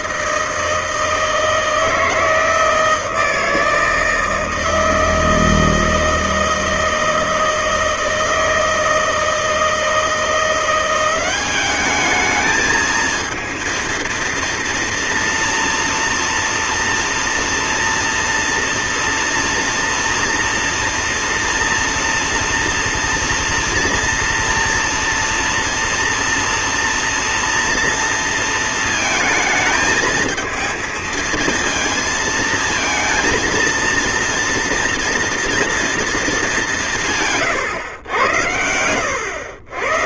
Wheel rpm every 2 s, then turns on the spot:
160, 160, 160, 160, 160, 170, 220, 230, 240, 230, 230, 230, 230, 230, 220, 220, 230, 230, 210, 100.
38-40